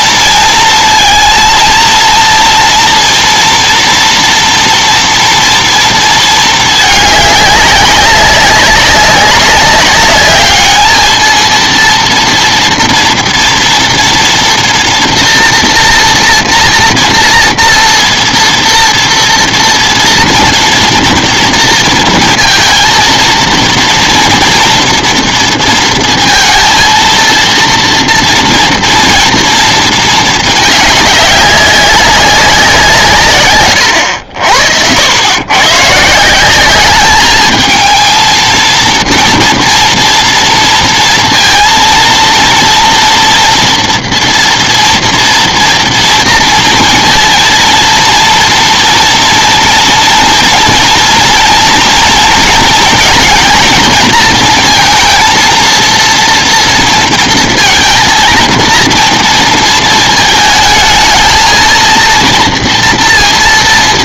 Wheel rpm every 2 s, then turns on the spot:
220, 230, 230, 210, 200, 220, 230, 240, 230, 230, 230, 230, 230, 230, 230, 210, 170, 80, 200, 230, 230, 230, 230, 230, 230, 230, 230, 230, 230, 230, 220, 230.
none